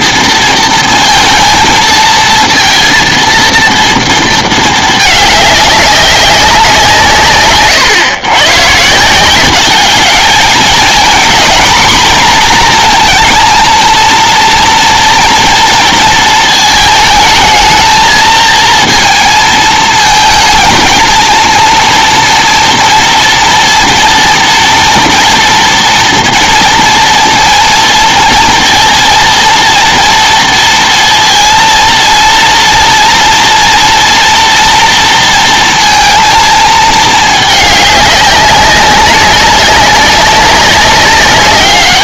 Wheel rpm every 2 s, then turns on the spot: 230, 230, 220, 150, 140, 220, 230, 230, 220, 230, 230, 230, 230, 230, 230, 230, 240, 230, 220, 200, 190.
none